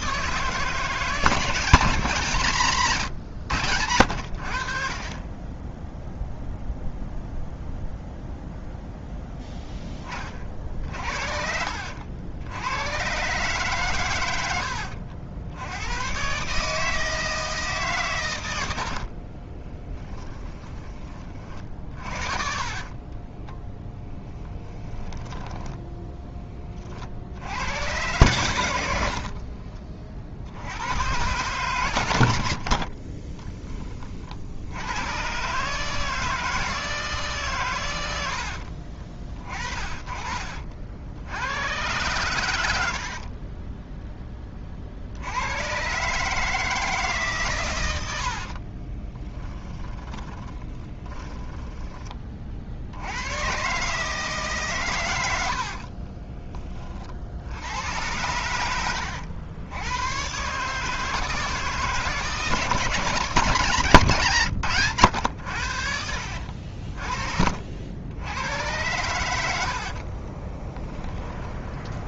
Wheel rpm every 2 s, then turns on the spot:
160, 130, 30, 0, 0, 50, 110, 80, 150, 80, 20, 30, 10, 50, 80, 100, 50, 100, 160, 40, 60, 70, 60, 150, 30, 20, 80, 110, 50, 100, 150, 170, 110, 50, 100, 20.
14-16 18-24 28-30 32-34 48-52 58-60 66-68 70-72